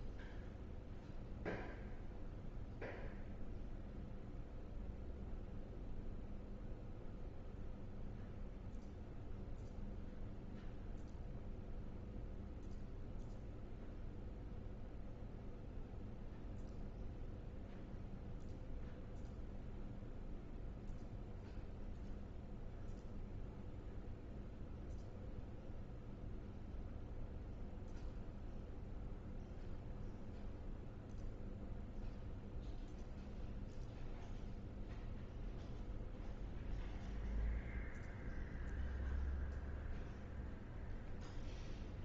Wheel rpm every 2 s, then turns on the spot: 0, 0, 0, 0, 0, 0, 0, 0, 0, 0, 0, 0, 0, 0, 0, 0, 0, 0, 0, 0, 0.
none